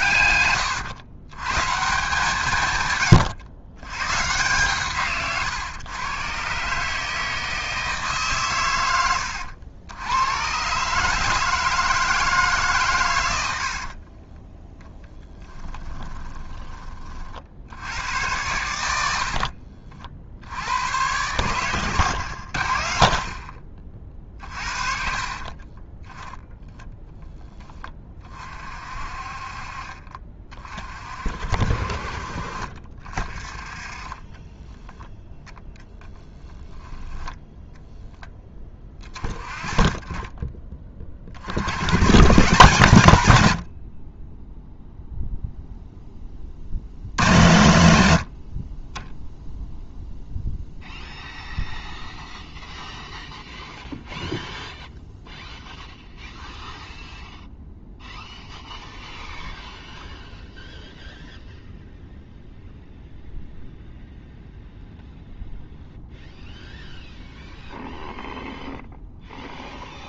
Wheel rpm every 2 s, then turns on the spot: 120, 140, 150, 140, 130, 120, 150, 20, 20, 90, 80, 70, 40, 0, 40, 30, 40, 20, 10, 20, 20, 140, 10, 50, 70, 0, 0, 0, 0, 0, 0, 0, 0, 0, 0.
0-2 36-38